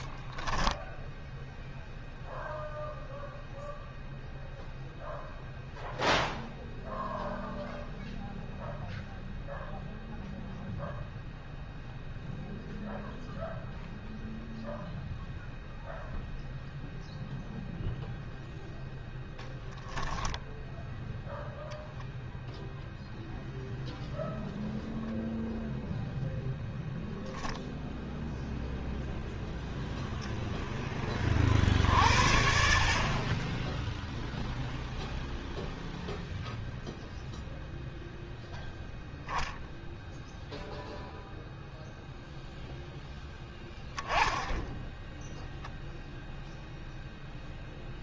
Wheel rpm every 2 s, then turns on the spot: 0, 0, 0, 0, 0, 0, 0, 0, 0, 0, 0, 0, 0, 0, 0, 10, 60, 0, 0, 0, 0, 0, 10, 0.
none